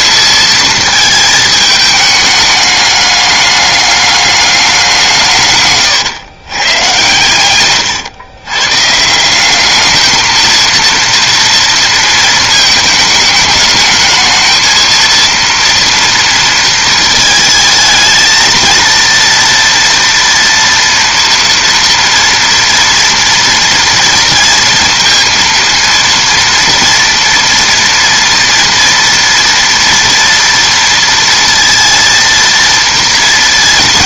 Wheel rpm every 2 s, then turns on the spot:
220, 210, 190, 120, 140, 230, 220, 220, 220, 230, 230, 230, 230, 230, 230, 230, 230.
none